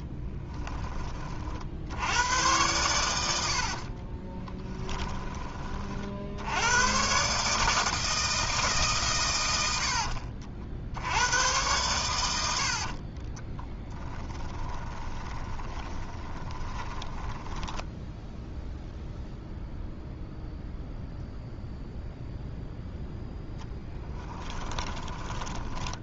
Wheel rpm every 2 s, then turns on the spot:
10, 110, 10, 110, 140, 70, 50, 20, 20, 0, 0, 0, 10.
4-6 12-18 24-26